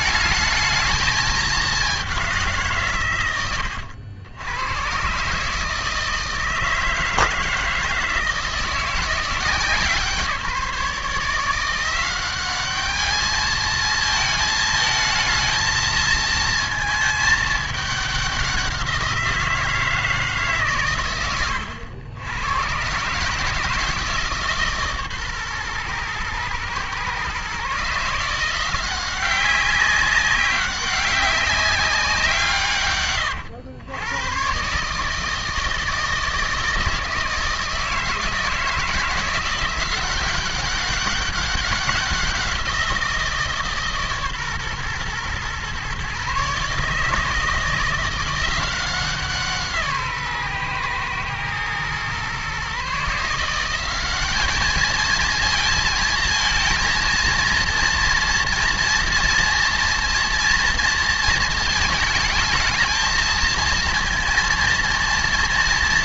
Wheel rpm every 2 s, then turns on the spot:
220, 160, 120, 160, 160, 160, 200, 220, 230, 190, 140, 120, 150, 120, 170, 200, 140, 130, 160, 160, 190, 180, 130, 140, 180, 130, 130, 210, 230, 230, 230, 220, 230.
none